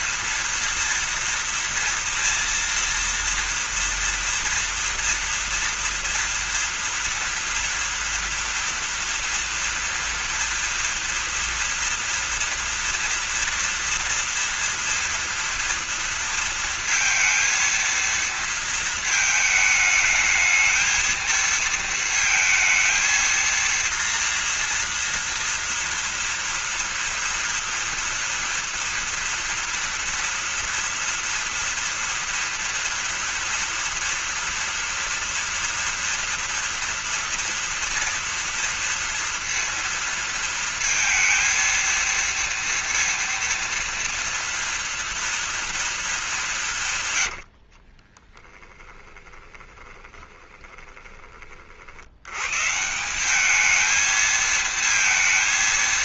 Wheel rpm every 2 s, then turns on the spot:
230, 230, 230, 240, 230, 230, 230, 230, 230, 230, 220, 230, 240, 230, 230, 240, 230, 230, 230, 230, 230, 230, 230, 200, 20, 20, 130, 220.
48-52